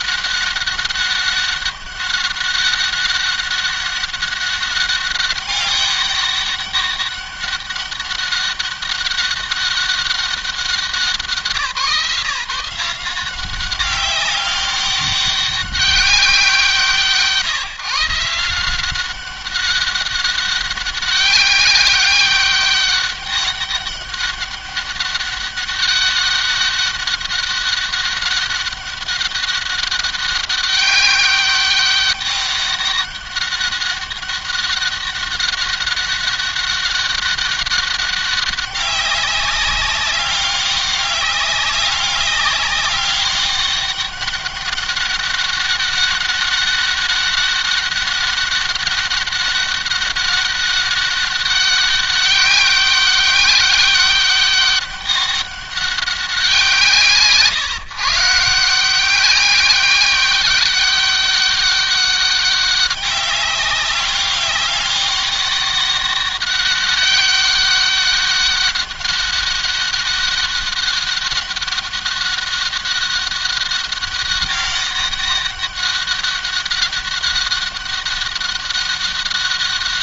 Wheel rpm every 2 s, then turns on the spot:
200, 200, 200, 200, 190, 180, 170, 200, 170, 160, 200, 200, 200, 200, 190, 200, 200, 200, 200, 200, 200, 200, 200, 200, 200, 200, 190, 200, 180, 170, 200, 190, 200, 200, 200, 200, 200, 200, 200, 200.
none